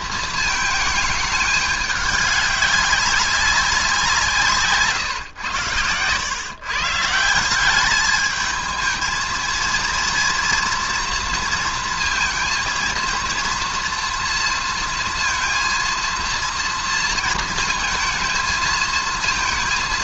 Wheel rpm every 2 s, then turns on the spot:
220, 200, 150, 140, 220, 230, 230, 230, 230, 230.
none